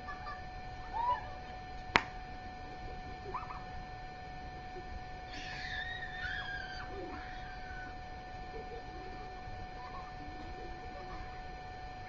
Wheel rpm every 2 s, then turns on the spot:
0, 0, 0, 0, 0, 0.
none